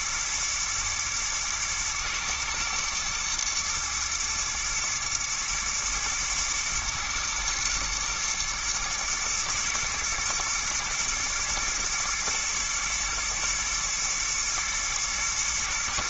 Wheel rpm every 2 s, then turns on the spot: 110, 120, 110, 120, 120, 120, 110, 110.
none